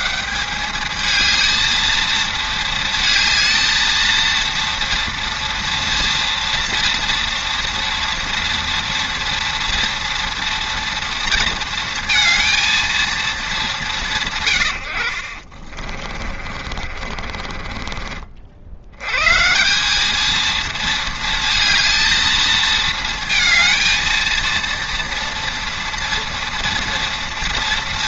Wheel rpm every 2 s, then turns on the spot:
180, 220, 230, 230, 230, 230, 230, 110, 50, 60, 220, 230, 230, 230.
16-18